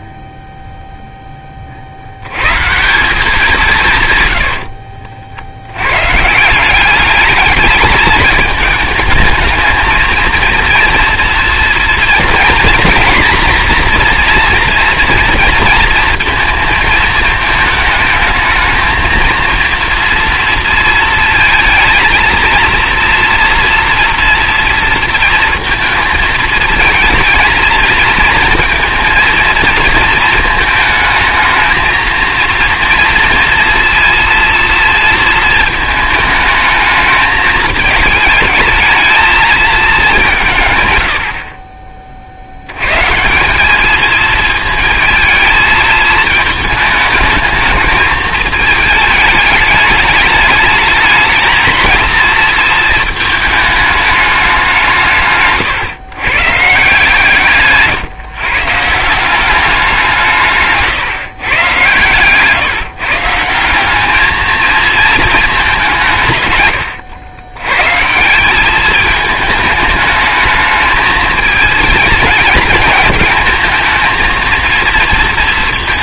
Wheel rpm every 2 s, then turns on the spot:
0, 140, 80, 180, 210, 230, 240, 230, 230, 220, 230, 230, 230, 220, 230, 220, 230, 230, 220, 220, 140, 80, 220, 220, 210, 210, 230, 190, 140, 140, 140, 140, 220, 130, 200, 220, 220, 230.
4-6